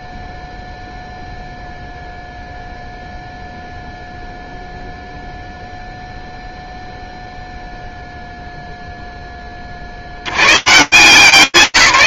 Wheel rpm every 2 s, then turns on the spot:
0, 0, 0, 0, 70, 160.
none